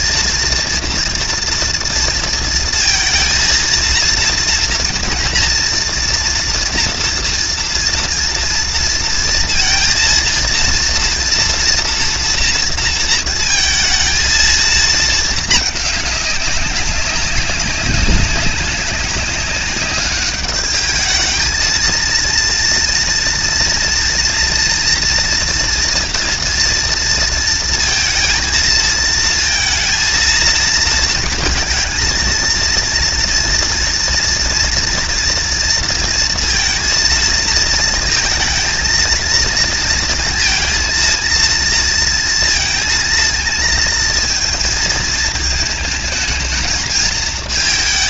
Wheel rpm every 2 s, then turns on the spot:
230, 230, 230, 240, 230, 230, 230, 220, 190, 200, 220, 230, 230, 230, 230, 230, 230, 230, 230, 220, 230, 230, 220, 220.
none